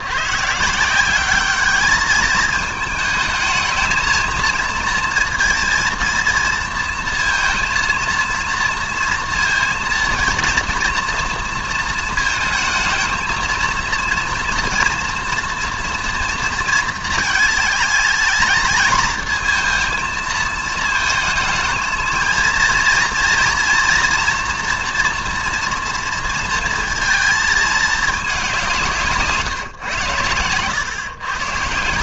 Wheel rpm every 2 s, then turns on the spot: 160, 220, 220, 230, 230, 230, 220, 230, 230, 230, 220, 230, 240, 230, 170, 110.
none